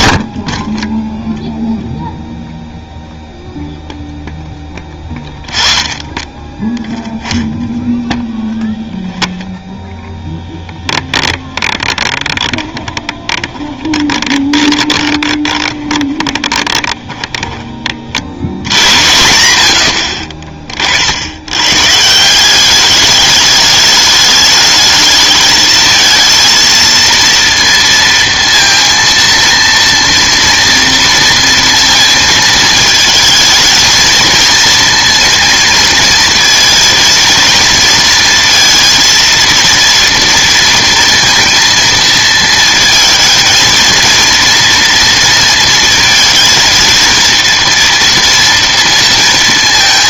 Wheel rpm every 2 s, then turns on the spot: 10, 0, 10, 10, 10, 10, 20, 30, 20, 80, 40, 200, 220, 230, 230, 230, 220, 230, 230, 230, 230, 230, 230, 230, 230.
10-18